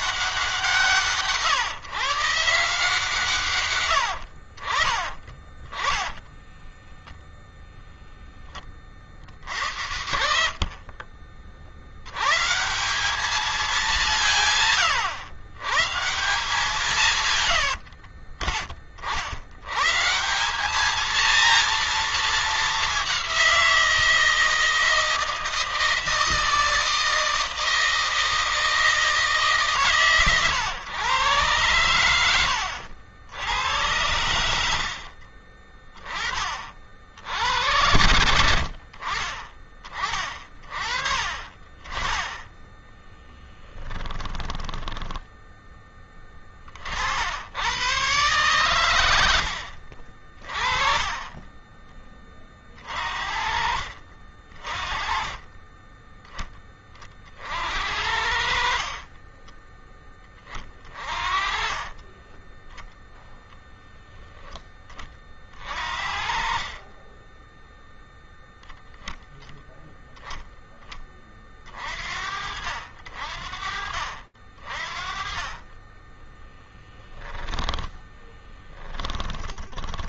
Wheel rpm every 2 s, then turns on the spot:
180, 160, 60, 10, 10, 60, 120, 170, 170, 40, 180, 220, 160, 160, 160, 130, 90, 80, 40, 90, 40, 20, 20, 30, 130, 40, 40, 40, 20, 50, 20, 30, 0, 40, 0, 10, 60, 40, 10, 30.
6-8 32-34 44-46 60-62 76-80